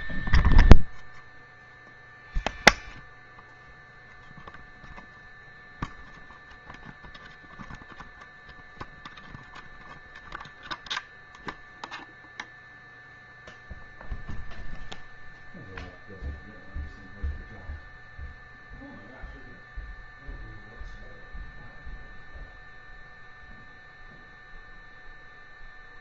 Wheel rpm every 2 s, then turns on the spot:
0, 0, 0, 0, 0, 0, 0, 0, 0, 0, 0, 0, 0.
none